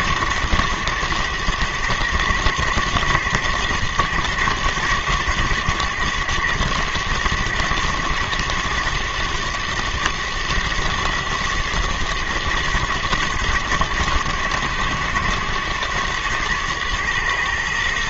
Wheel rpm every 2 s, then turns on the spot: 110, 120, 110, 110, 110, 110, 110, 110, 110.
none